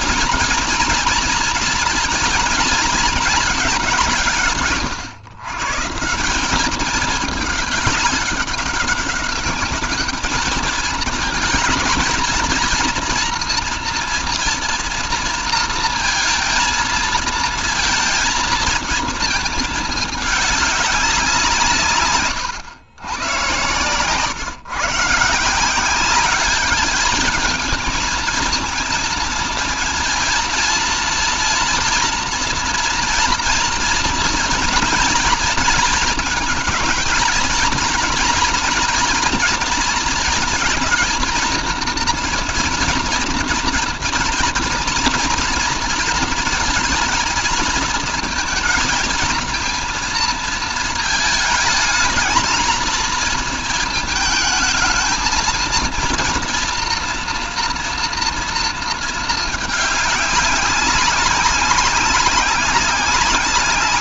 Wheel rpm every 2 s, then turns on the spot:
230, 220, 130, 210, 200, 220, 230, 230, 230, 230, 200, 120, 140, 210, 230, 240, 240, 230, 220, 230, 230, 240, 230, 220, 220, 220, 230, 220, 230, 230, 200, 190.
none